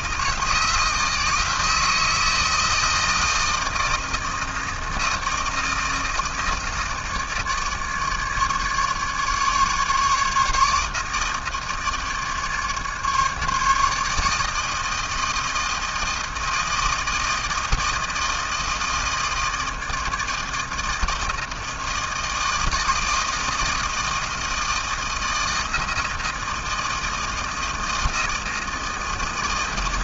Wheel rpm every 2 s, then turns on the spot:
160, 160, 160, 160, 150, 160, 150, 160, 160, 160, 160, 160, 160, 160, 160.
none